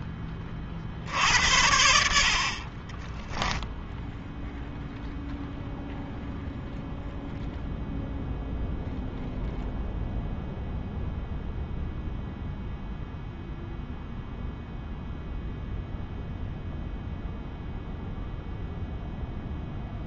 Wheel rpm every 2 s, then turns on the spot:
30, 40, 0, 0, 0, 0, 0, 0, 0, 0.
2-4